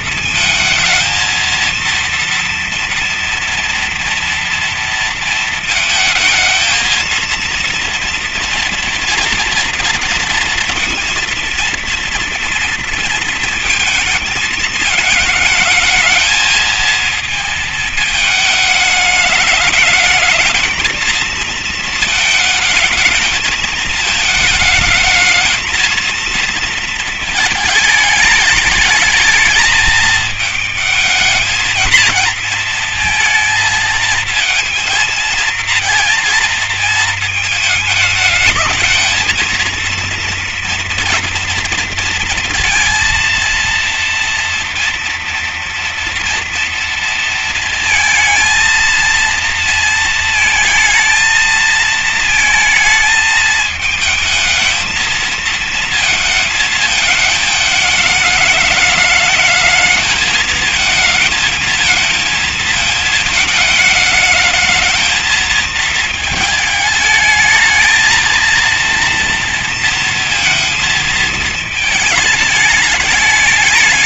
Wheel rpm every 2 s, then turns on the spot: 230, 230, 230, 230, 230, 230, 230, 220, 220, 210, 220, 210, 210, 230, 220, 220, 230, 220, 220, 210, 230, 230, 230, 230, 230, 220, 220, 220, 220, 210, 220, 230, 220, 220, 230, 230, 210.
none